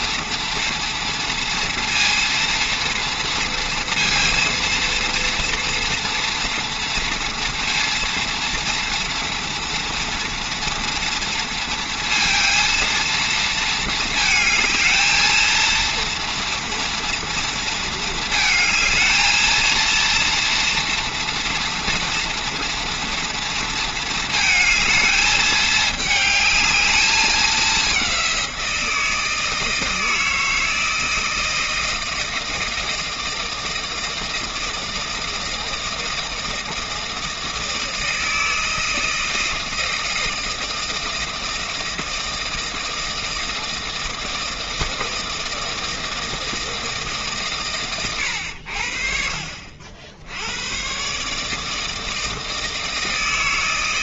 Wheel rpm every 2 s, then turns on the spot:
230, 230, 230, 240, 230, 230, 230, 220, 230, 220, 230, 230, 220, 210, 170, 160, 160, 160, 160, 160, 160, 160, 160, 160, 70, 110, 160.
none